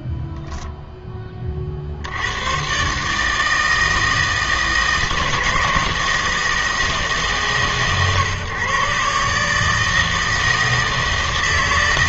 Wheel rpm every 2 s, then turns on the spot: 20, 150, 160, 150, 140, 160.
none